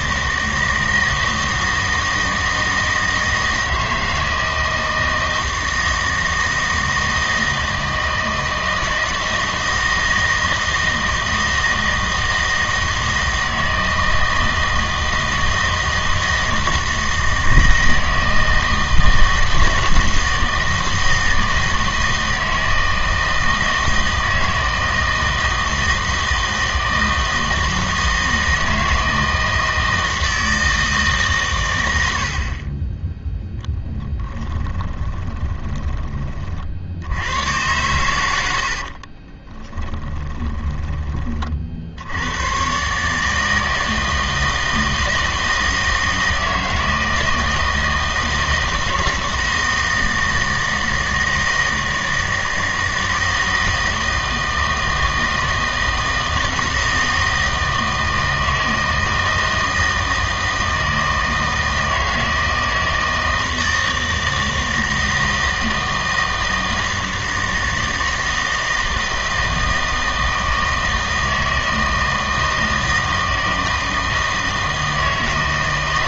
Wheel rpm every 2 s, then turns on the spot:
160, 160, 160, 160, 160, 160, 160, 160, 160, 160, 160, 160, 160, 160, 160, 160, 30, 10, 50, 70, 20, 140, 160, 160, 160, 160, 160, 160, 160, 160, 160, 160, 160, 160, 160, 160, 160, 160.
34-36 38-42